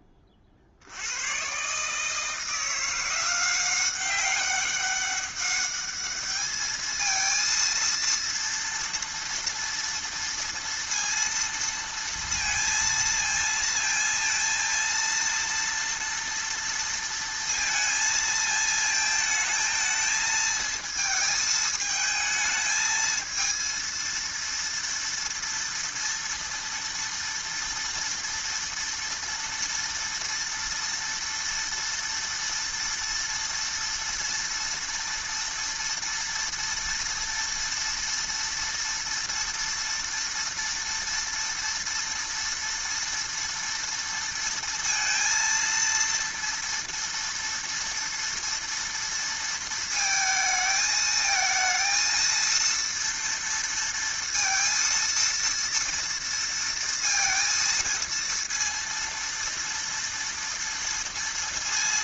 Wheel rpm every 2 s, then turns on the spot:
80, 170, 200, 220, 230, 230, 230, 230, 230, 220, 220, 220, 230, 230, 230, 230, 240, 230, 230, 230, 230, 230, 230, 230, 230, 220, 230, 230, 230, 230, 230.
none